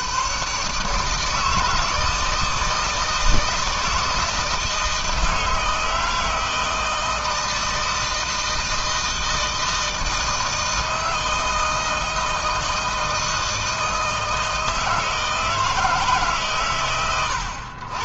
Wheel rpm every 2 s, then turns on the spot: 150, 160, 160, 160, 160, 160, 160, 160, 100.
none